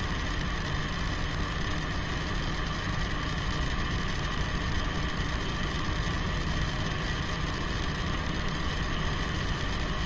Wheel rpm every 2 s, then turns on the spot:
0, 0, 0, 0, 0.
none